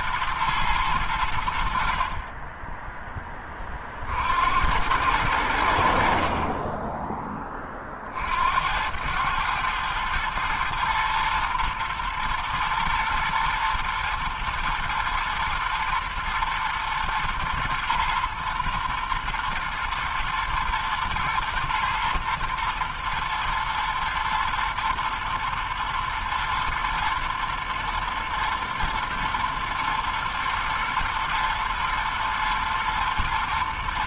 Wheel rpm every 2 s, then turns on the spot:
110, 30, 60, 50, 60, 110, 110, 110, 110, 120, 120, 120, 110, 120, 120, 110, 110.
none